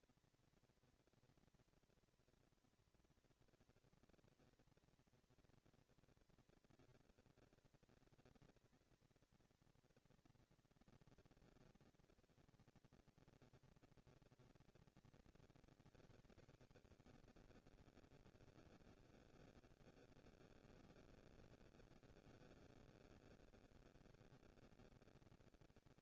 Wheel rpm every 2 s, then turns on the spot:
240, 230, 230, 230, 230, 230, 230, 230, 250, 210, 140, 100, 200.
none